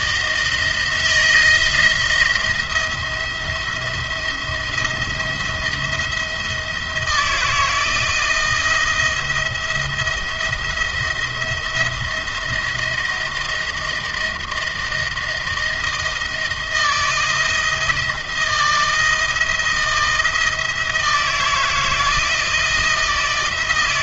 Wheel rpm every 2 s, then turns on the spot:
160, 170, 170, 170, 170, 170, 170, 160, 160, 160, 160, 170.
none